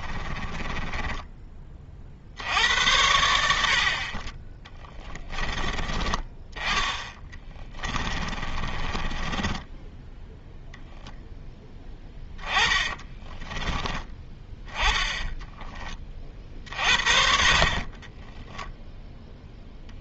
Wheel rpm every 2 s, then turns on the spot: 20, 80, 20, 10, 30, 0, 20, 10, 60, 0.
0-2 4-6 8-10 12-14